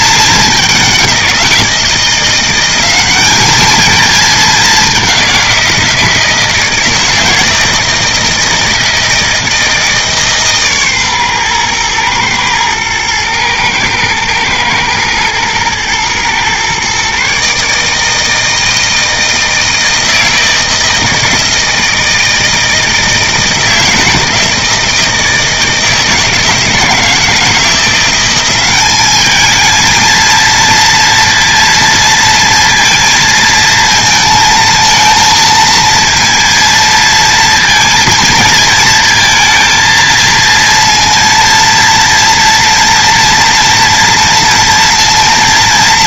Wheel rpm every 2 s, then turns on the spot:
190, 190, 200, 160, 160, 130, 110, 110, 130, 160, 160, 160, 160, 160, 200, 230, 230, 220, 230, 220, 230, 230, 230.
none